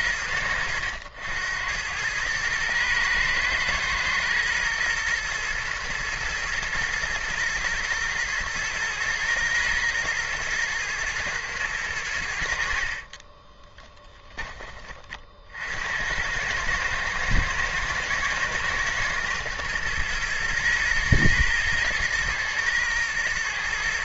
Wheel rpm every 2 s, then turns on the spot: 80, 110, 110, 110, 110, 110, 50, 30, 110, 110, 120, 110.
12-14